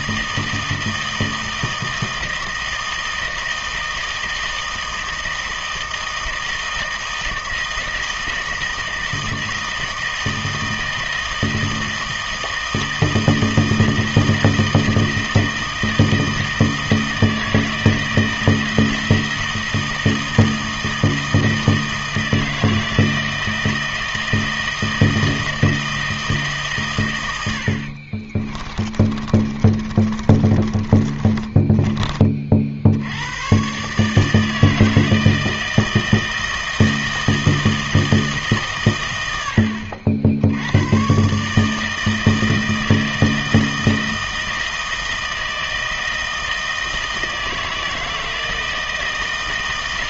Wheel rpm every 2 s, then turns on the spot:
160, 160, 160, 160, 160, 160, 160, 160, 160, 160, 160, 160, 160, 150, 30, 30, 50, 160, 160, 150, 100, 160, 160, 160, 160.
28-32